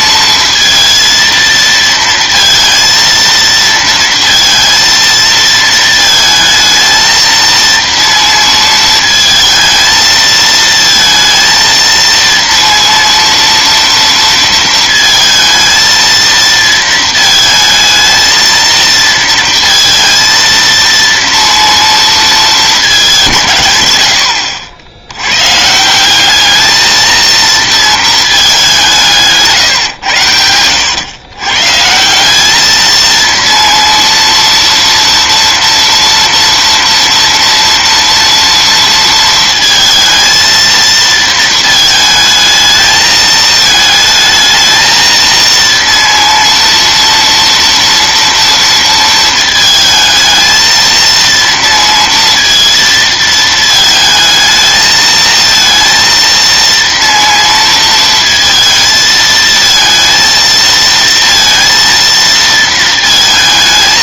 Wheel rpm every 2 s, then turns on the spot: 230, 230, 230, 220, 230, 230, 230, 230, 230, 230, 230, 220, 70, 210, 200, 100, 210, 230, 230, 230, 230, 220, 220, 230, 230, 220, 230, 220, 230, 230, 230, 230.
none